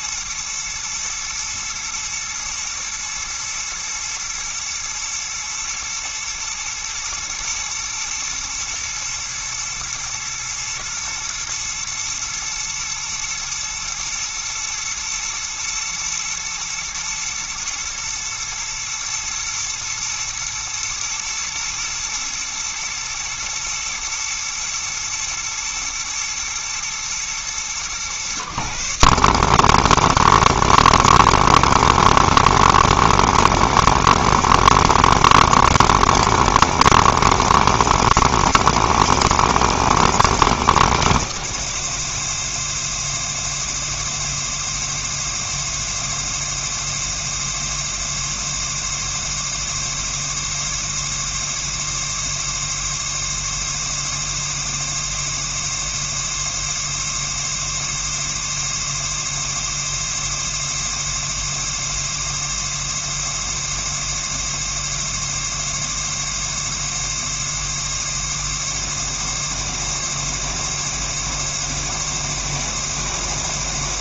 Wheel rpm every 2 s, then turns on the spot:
110, 110, 110, 110, 110, 110, 110, 120, 110, 110, 110, 120, 110, 120, 110, 110, 120, 110, 110, 130, 120, 110, 110, 110, 110, 110, 110, 110, 110, 110, 110, 110, 110, 110, 110, 110, 110.
none